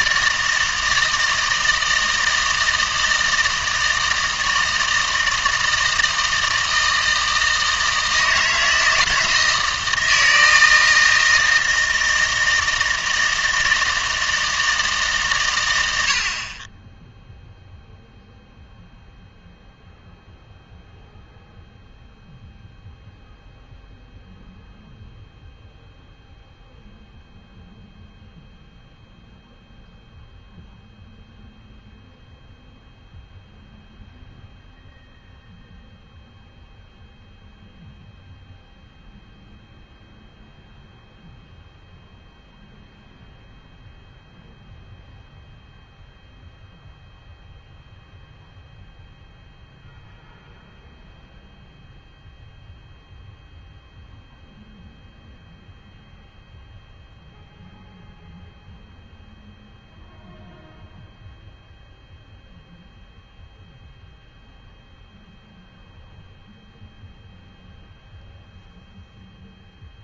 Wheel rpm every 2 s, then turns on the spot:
160, 160, 160, 160, 160, 160, 160, 160, 20, 0, 0, 0, 0, 0, 0, 0, 0, 0, 0, 0, 0, 0, 0, 0, 0, 0, 0, 0, 0, 0, 0, 0, 0, 0, 0.
none